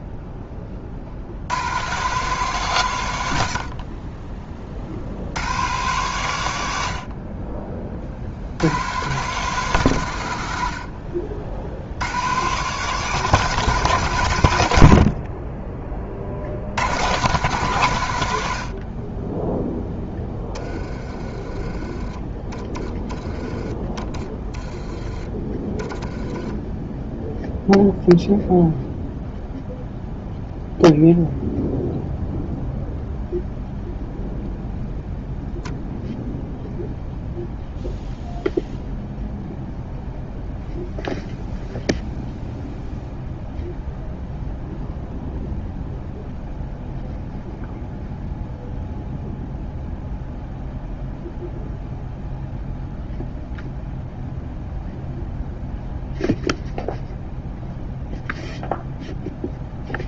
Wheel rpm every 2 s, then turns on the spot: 30, 140, 50, 90, 100, 70, 150, 90, 80, 60, 20, 20, 10, 0, 0, 0, 0, 0, 0, 0, 0, 0, 0, 0, 0, 0, 0, 0, 0, 0.
none